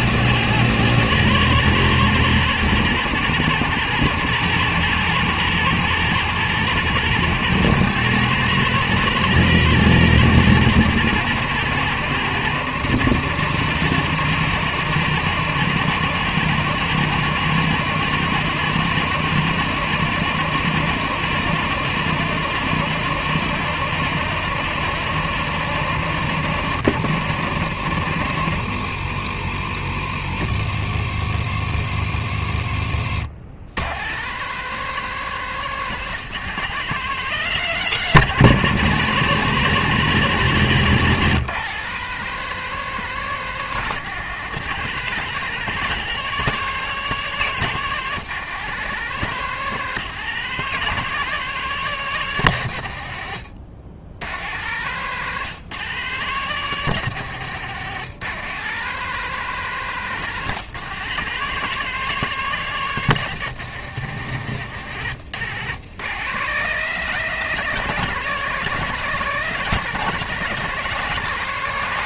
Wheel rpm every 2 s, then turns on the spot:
130, 110, 120, 120, 130, 110, 100, 110, 110, 110, 110, 110, 100, 100, 70, 70, 70, 170, 160, 130, 130, 170, 160, 170, 160, 170, 100, 120, 150, 160, 160, 160, 120, 160, 160, 150.
32-34